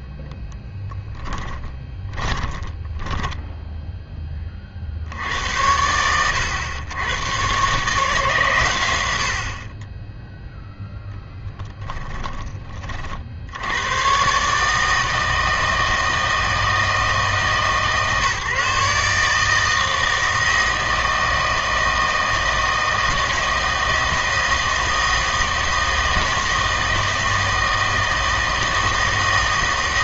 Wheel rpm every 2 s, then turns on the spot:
10, 20, 30, 110, 130, 0, 20, 140, 160, 150, 160, 160, 160, 160, 160.
0-4